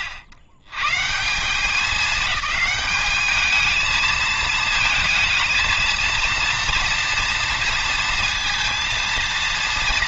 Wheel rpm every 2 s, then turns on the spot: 130, 210, 220, 230, 230.
none